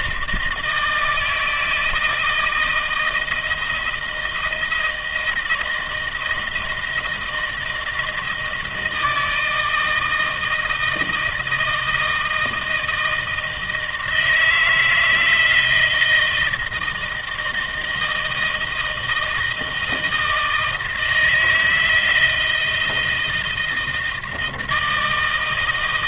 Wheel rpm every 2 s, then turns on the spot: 160, 160, 160, 160, 160, 160, 160, 160, 170, 160, 160, 160, 160.
none